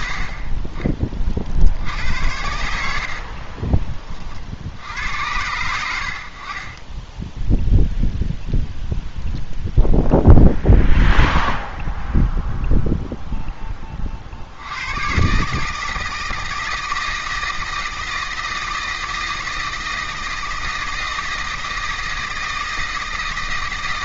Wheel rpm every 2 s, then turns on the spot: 40, 80, 80, 20, 0, 0, 0, 100, 160, 160, 160, 160.
none